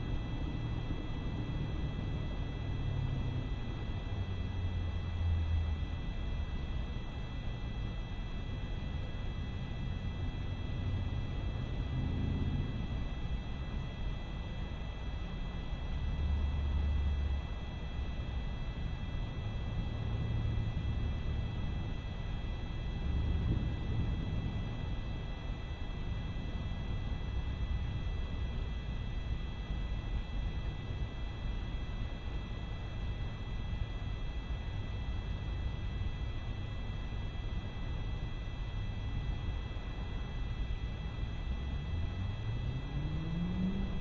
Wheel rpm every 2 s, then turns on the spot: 0, 0, 0, 0, 0, 0, 0, 0, 0, 0, 0, 0, 0, 0, 0, 0, 0, 0, 0, 0, 0, 0.
none